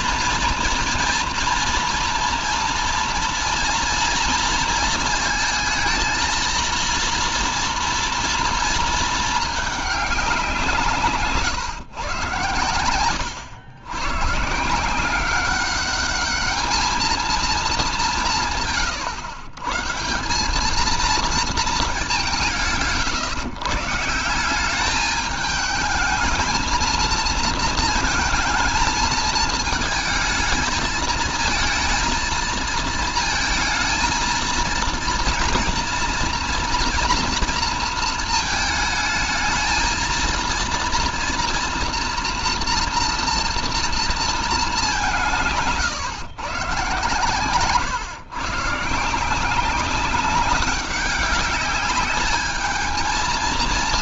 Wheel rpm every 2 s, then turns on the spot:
230, 230, 230, 230, 230, 160, 120, 150, 220, 150, 210, 170, 190, 220, 220, 220, 230, 230, 230, 220, 230, 240, 200, 140, 140, 200, 220.
none